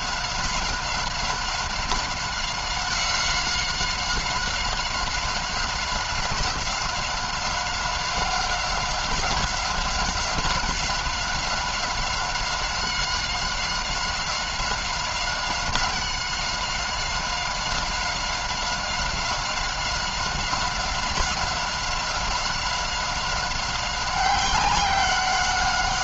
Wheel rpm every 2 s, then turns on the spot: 190, 190, 180, 190, 190, 190, 190, 190, 190, 190, 190, 190, 190.
none